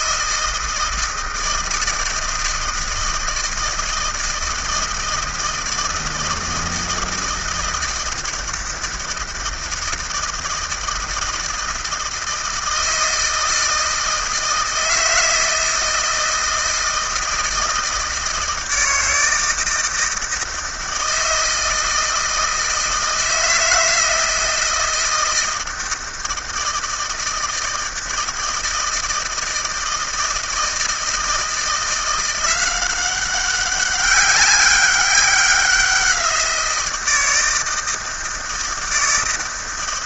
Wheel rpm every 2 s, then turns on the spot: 160, 160, 160, 160, 160, 160, 160, 160, 160, 160, 160, 160, 160, 160, 160, 160, 180, 200, 170, 160.
none